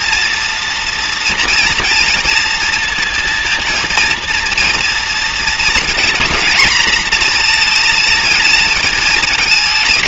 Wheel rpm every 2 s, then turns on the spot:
230, 230, 230, 240, 210.
none